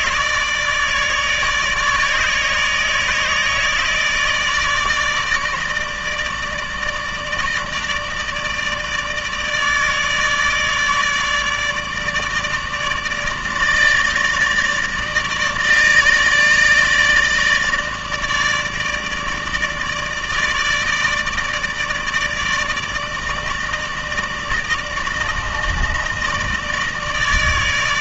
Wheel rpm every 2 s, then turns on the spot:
150, 150, 160, 150, 150, 150, 160, 160, 150, 150, 160, 160, 160, 160.
none